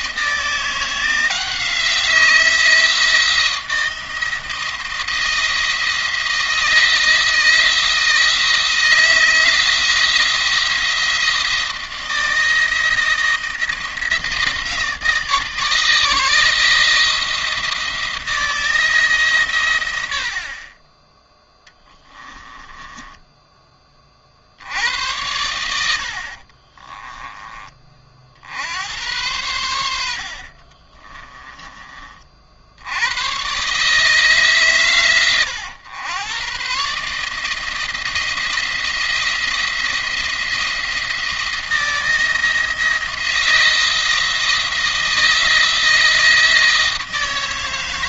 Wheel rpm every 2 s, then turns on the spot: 170, 170, 170, 160, 160, 170, 170, 160, 160, 160, 20, 10, 80, 20, 80, 30, 80, 130, 130, 170, 170, 160, 160, 160.
22-24 26-28 30-32